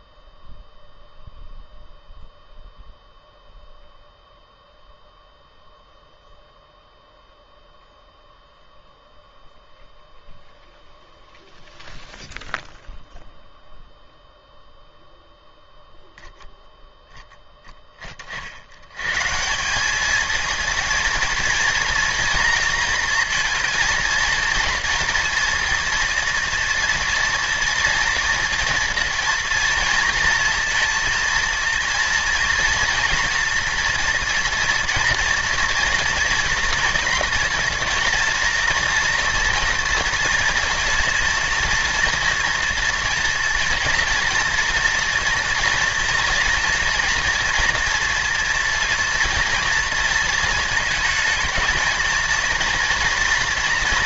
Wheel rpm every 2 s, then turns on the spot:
0, 0, 0, 0, 0, 0, 0, 0, 0, 80, 220, 230, 230, 230, 230, 230, 230, 240, 240, 240, 230, 240, 240, 240, 240, 230, 230.
none